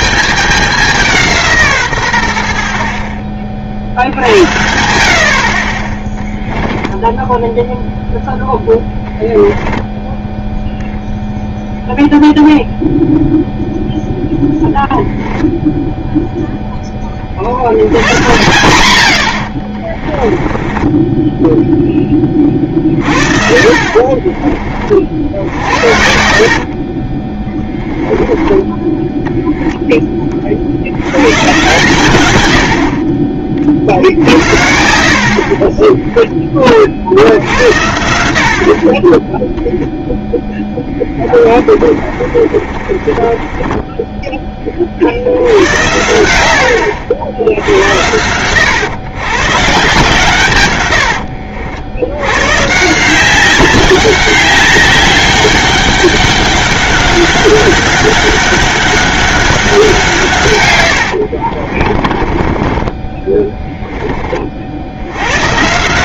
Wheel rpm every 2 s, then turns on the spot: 200, 50, 80, 10, 30, 0, 0, 0, 10, 100, 10, 40, 40, 40, 10, 60, 80, 50, 30, 60, 10, 30, 30, 80, 110, 110, 140, 200, 190, 200, 130, 20, 60.
6-10 22-24 26-28 40-44 60-64